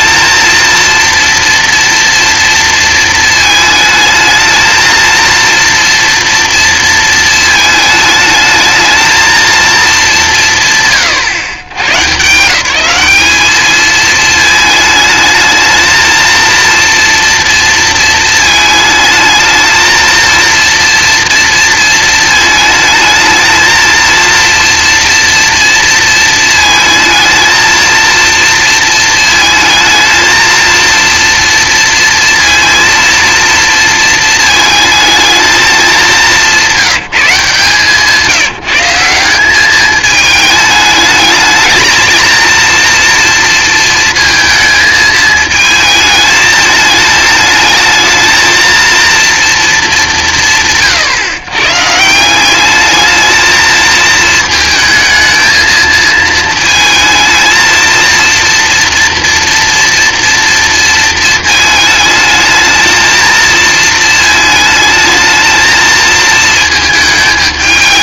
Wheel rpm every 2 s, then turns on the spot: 230, 230, 220, 230, 220, 170, 170, 220, 230, 220, 230, 220, 230, 220, 230, 230, 230, 220, 190, 180, 210, 230, 220, 220, 230, 150, 200, 220, 220, 230, 230, 220, 220, 220.
none